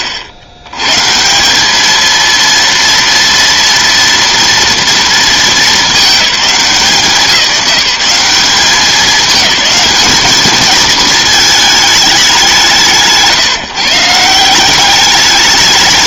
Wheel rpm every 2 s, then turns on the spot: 70, 230, 230, 180, 210, 220, 150, 190.
none